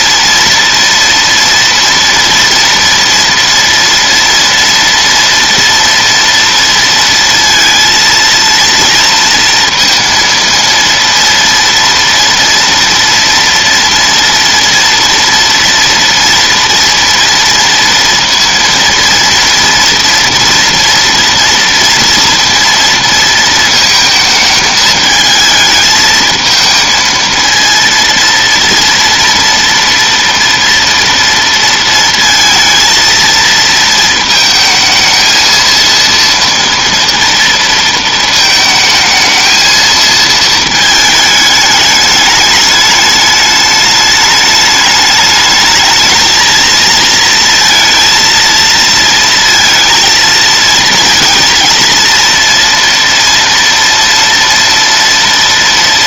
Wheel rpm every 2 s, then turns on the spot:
230, 230, 230, 230, 230, 230, 230, 230, 230, 230, 240, 230, 220, 220, 230, 230, 230, 220, 230, 220, 220, 210, 210, 230, 230, 230, 230, 230.
none